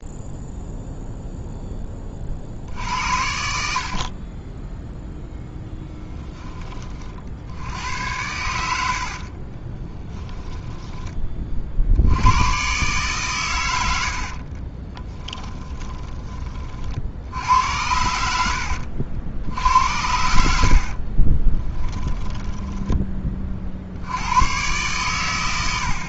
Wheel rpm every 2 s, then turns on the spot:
0, 60, 10, 40, 70, 20, 130, 20, 50, 70, 60, 10, 120.
14-16 20-22